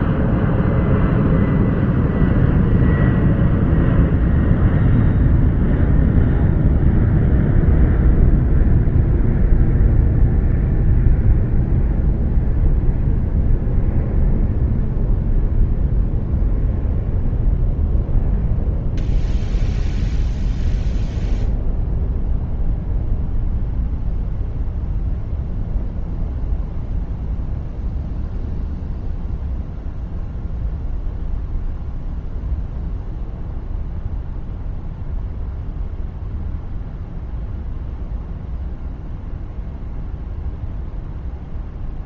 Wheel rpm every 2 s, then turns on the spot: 0, 0, 0, 0, 0, 0, 0, 0, 0, 0, 0, 0, 0, 0, 0, 0, 0, 0, 0, 0, 0.
none